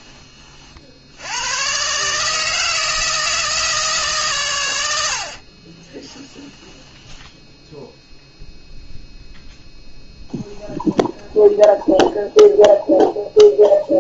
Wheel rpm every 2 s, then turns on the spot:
50, 160, 100, 10, 0, 0, 0.
6-8